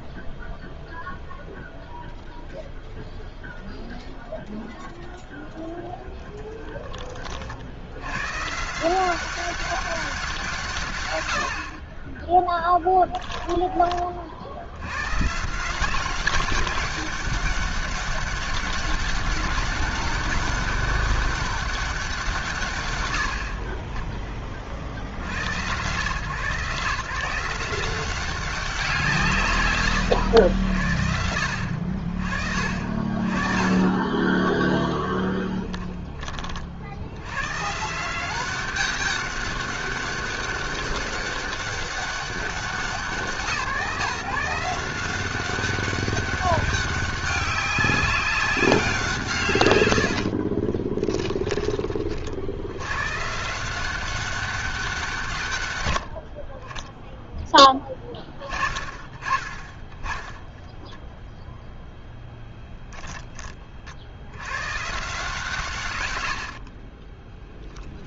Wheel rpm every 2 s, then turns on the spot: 0, 0, 10, 110, 190, 20, 20, 190, 200, 200, 200, 20, 100, 170, 120, 60, 30, 10, 110, 200, 200, 160, 190, 200, 170, 10, 130, 150, 10, 30, 10, 10, 150, 10.
34-36 50-52 66-68